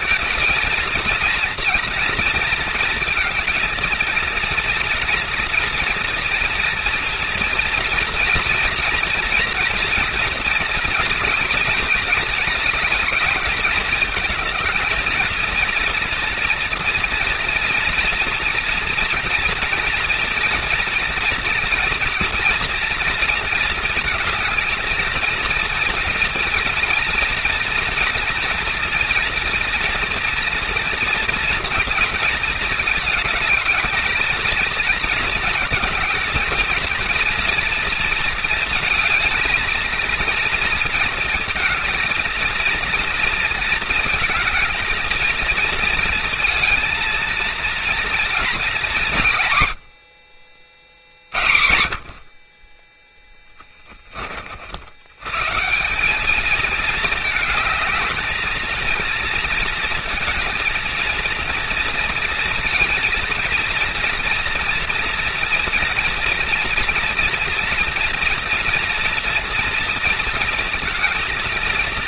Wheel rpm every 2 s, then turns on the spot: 230, 230, 230, 230, 240, 230, 220, 220, 240, 230, 230, 230, 220, 230, 230, 230, 220, 220, 220, 220, 230, 230, 220, 230, 200, 50, 30, 50, 210, 220, 230, 230, 230, 240, 230, 230.
none